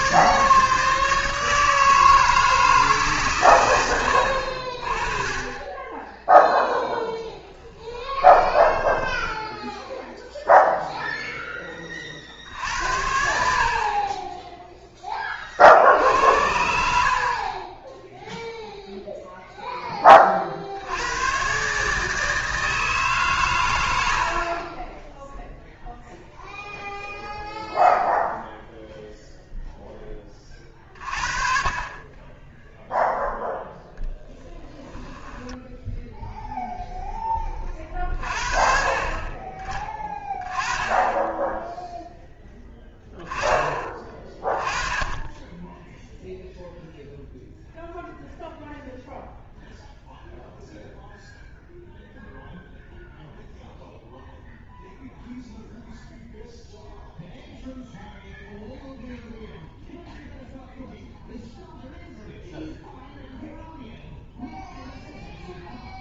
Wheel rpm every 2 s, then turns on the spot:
160, 160, 30, 0, 10, 0, 70, 10, 70, 0, 60, 150, 30, 0, 0, 30, 0, 10, 0, 40, 20, 10, 20, 0, 0, 0, 0, 0, 0, 0, 0, 0, 0.
8-10 34-36